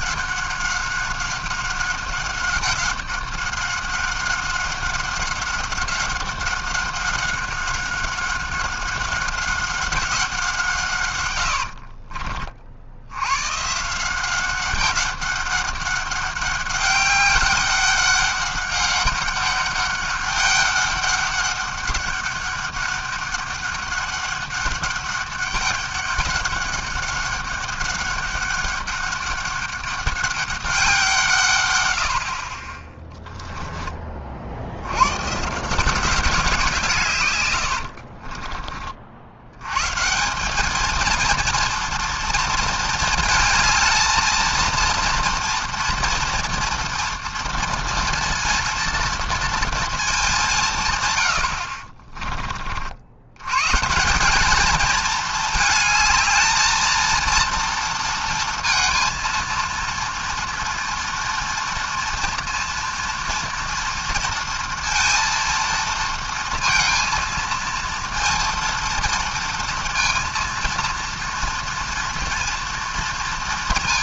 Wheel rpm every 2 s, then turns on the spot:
190, 190, 190, 190, 190, 170, 50, 190, 200, 200, 200, 200, 200, 200, 200, 200, 40, 70, 180, 30, 200, 230, 230, 230, 230, 170, 40, 210, 220, 230, 230, 230, 230, 230, 230, 230, 230.
38-40